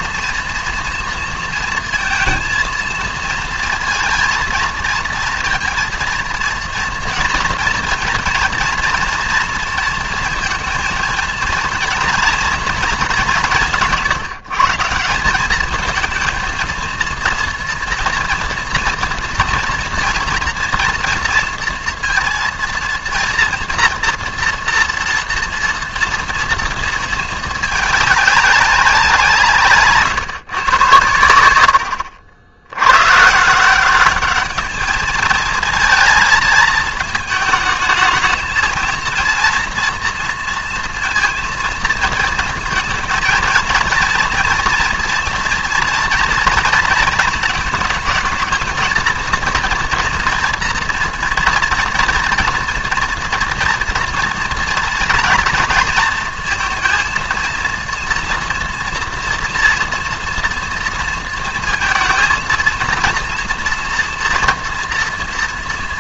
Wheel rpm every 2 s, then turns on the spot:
230, 230, 230, 230, 230, 230, 230, 170, 230, 230, 230, 230, 240, 230, 200, 130, 80, 210, 220, 230, 230, 220, 230, 230, 230, 230, 230, 230, 230, 230, 230, 230, 230.
none